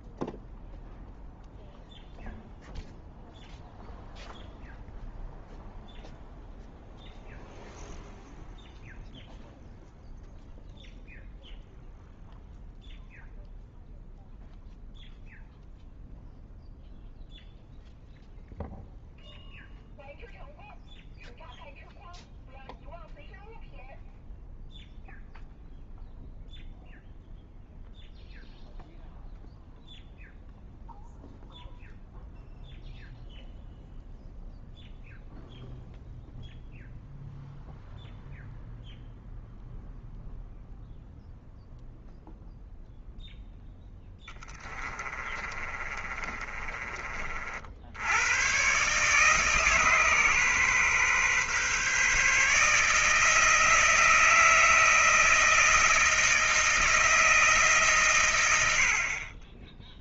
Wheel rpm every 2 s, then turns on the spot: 0, 0, 0, 0, 0, 0, 0, 0, 0, 0, 0, 0, 0, 0, 0, 0, 0, 0, 0, 0, 0, 0, 10, 30, 80, 150, 140, 160, 160, 130.
44-48